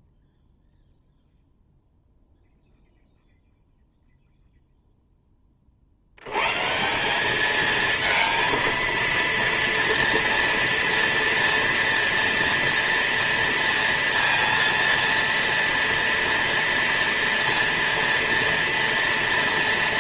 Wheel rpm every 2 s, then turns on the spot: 0, 0, 0, 170, 230, 230, 230, 230, 230, 230.
none